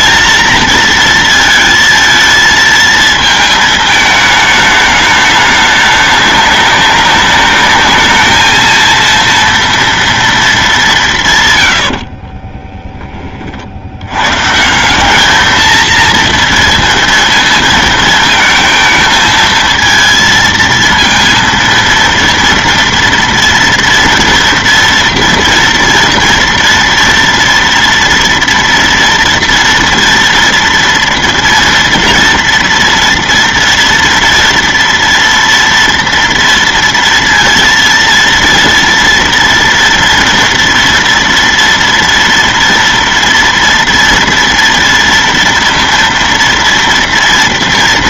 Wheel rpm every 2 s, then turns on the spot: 230, 220, 220, 200, 210, 230, 50, 140, 230, 220, 230, 230, 230, 230, 230, 230, 230, 230, 230, 230, 230, 230, 230, 230.
12-14